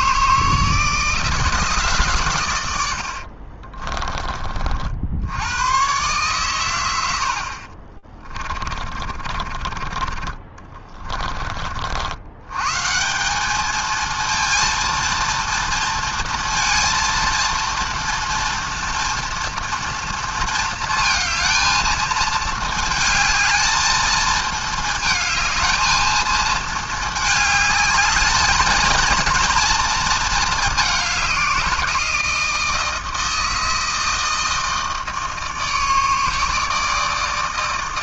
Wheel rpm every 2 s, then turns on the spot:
160, 100, 40, 120, 40, 40, 120, 230, 230, 230, 230, 220, 220, 220, 220, 220, 170, 160, 160.
8-12